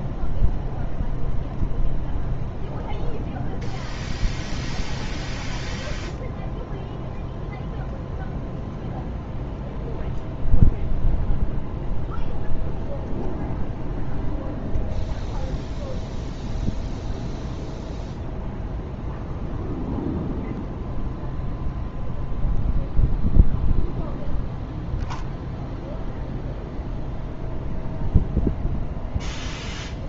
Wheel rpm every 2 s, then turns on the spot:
0, 0, 0, 0, 0, 0, 0, 0, 0, 0, 0, 0, 0, 0, 0.
none